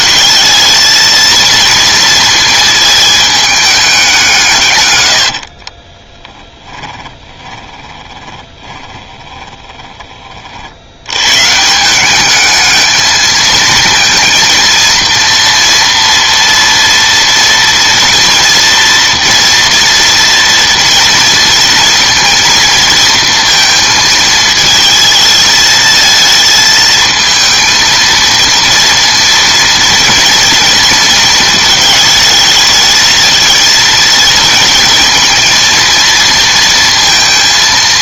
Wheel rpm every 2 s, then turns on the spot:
220, 230, 160, 10, 20, 40, 200, 220, 230, 230, 230, 230, 220, 220, 230, 230, 220, 220, 230.
6-10